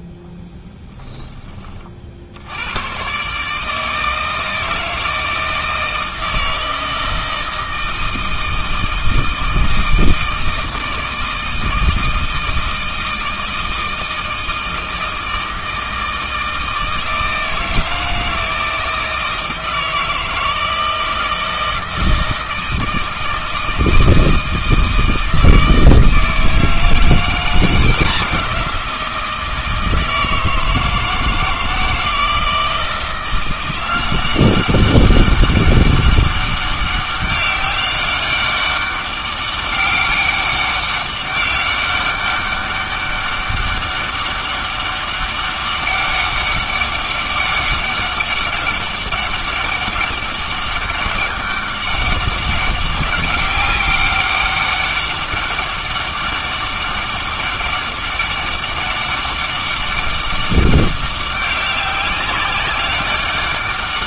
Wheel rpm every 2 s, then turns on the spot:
20, 100, 160, 160, 160, 160, 160, 160, 160, 160, 160, 160, 160, 160, 170, 160, 160, 190, 200, 200, 200, 200, 200, 190, 200, 200, 190, 200, 200, 200, 200, 190.
0-2